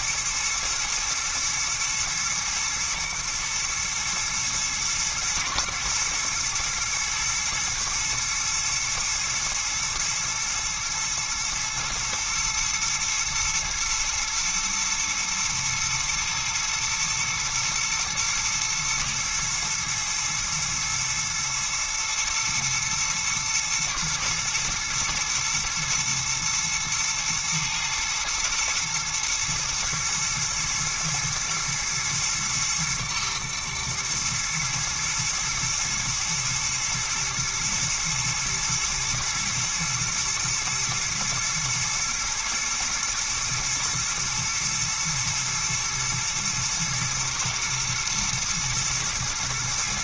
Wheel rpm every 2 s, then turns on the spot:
120, 110, 110, 110, 120, 120, 120, 120, 110, 110, 110, 110, 110, 110, 110, 110, 120, 120, 110, 110, 120, 110, 110, 120, 110.
none